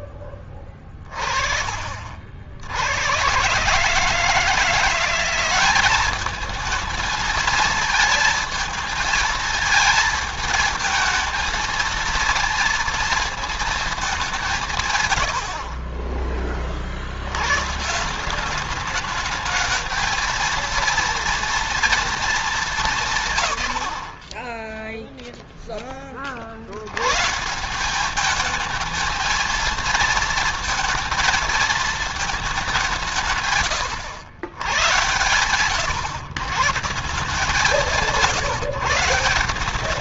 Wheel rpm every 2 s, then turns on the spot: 20, 70, 170, 220, 220, 220, 230, 160, 40, 200, 230, 190, 10, 70, 220, 230, 200, 110, 150, 160.
none